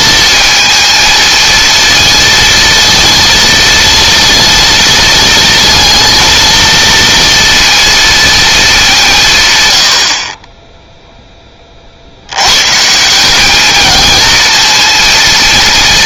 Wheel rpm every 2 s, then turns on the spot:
220, 230, 230, 230, 200, 10, 140, 230.
none